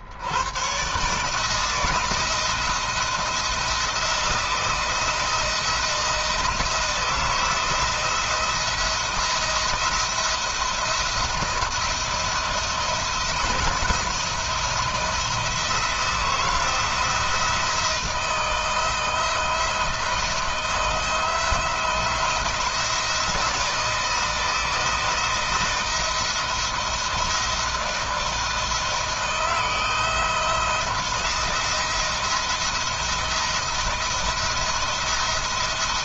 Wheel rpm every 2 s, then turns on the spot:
150, 170, 170, 160, 170, 170, 170, 170, 170, 160, 170, 170, 160, 170, 160, 170, 170, 160.
none